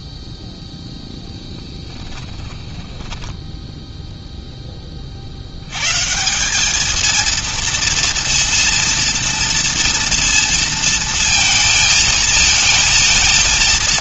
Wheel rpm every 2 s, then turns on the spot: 0, 20, 10, 200, 230, 230, 220.
none